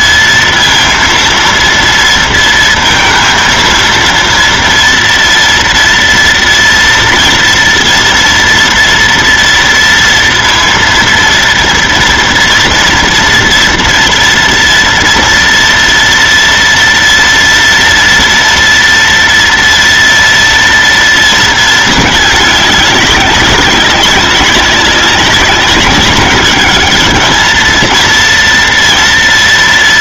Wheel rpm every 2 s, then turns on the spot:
230, 230, 230, 240, 230, 230, 230, 230, 230, 230, 230, 200, 200, 210, 230.
none